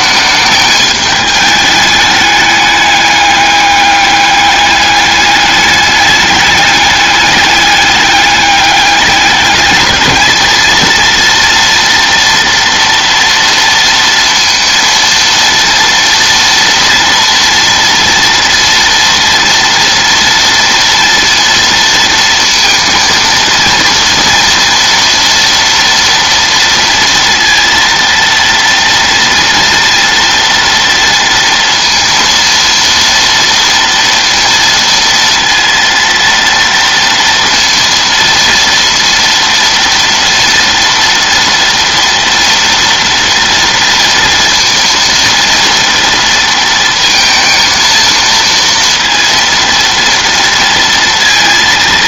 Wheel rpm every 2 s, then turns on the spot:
210, 200, 210, 200, 200, 230, 230, 230, 230, 230, 230, 230, 240, 230, 230, 230, 230, 230, 230, 230, 230, 230, 230, 230, 230, 230.
none